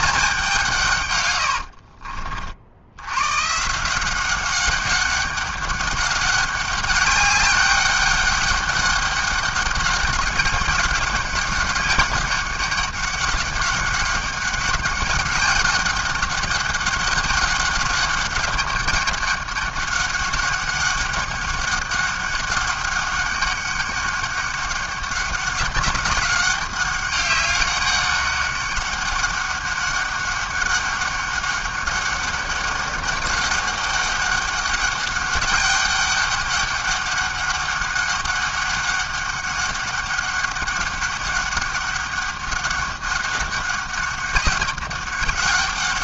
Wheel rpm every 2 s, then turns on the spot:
180, 60, 200, 200, 200, 200, 200, 200, 200, 200, 200, 200, 200, 190, 200, 200, 200, 200, 200, 200, 200, 200, 200.
none